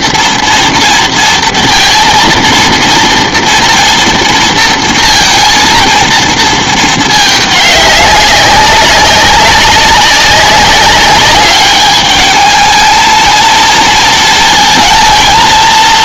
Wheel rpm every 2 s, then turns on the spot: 230, 230, 230, 220, 200, 200, 220, 230.
none